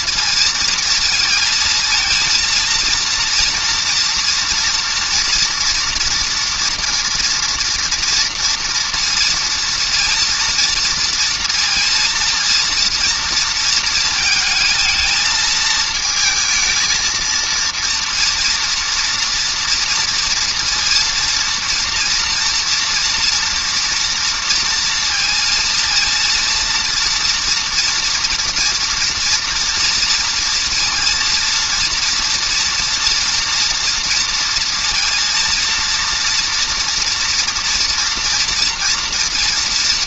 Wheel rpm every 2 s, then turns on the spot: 230, 230, 230, 230, 230, 230, 230, 230, 220, 230, 230, 230, 230, 230, 230, 230, 230, 240, 230, 240.
none